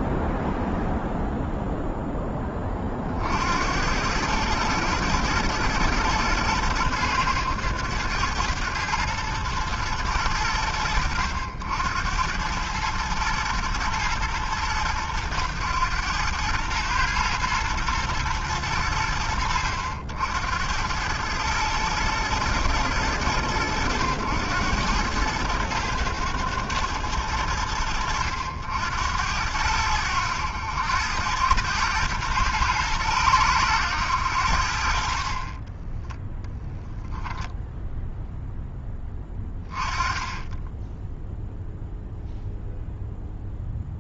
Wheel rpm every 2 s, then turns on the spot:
0, 60, 110, 110, 110, 80, 110, 110, 120, 90, 110, 90, 100, 80, 90, 110, 90, 0, 0, 10, 0, 0.
none